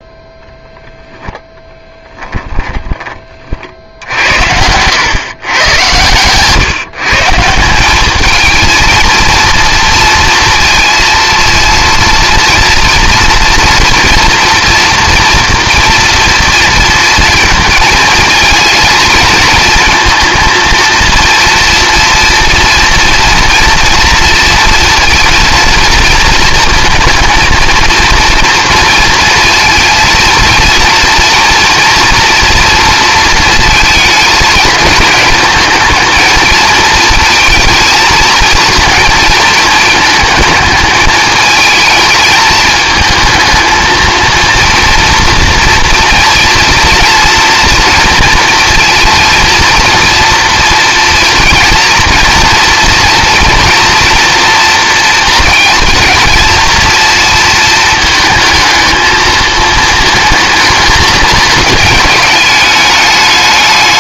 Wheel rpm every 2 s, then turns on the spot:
10, 30, 100, 140, 230, 230, 230, 230, 230, 220, 230, 240, 230, 220, 230, 230, 230, 220, 220, 220, 220, 220, 230, 230, 230, 230, 230, 230, 230, 220, 220, 210.
none